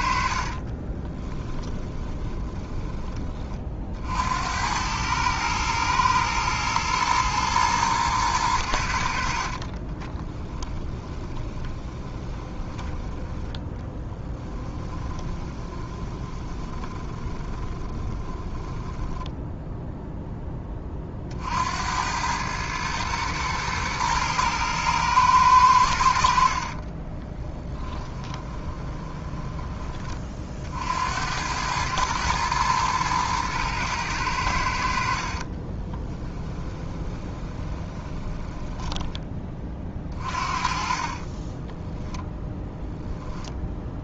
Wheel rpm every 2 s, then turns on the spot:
50, 20, 90, 110, 90, 20, 10, 10, 20, 20, 10, 110, 110, 60, 20, 50, 110, 80, 10, 10, 40, 0.
0-4 10-20 26-30 36-42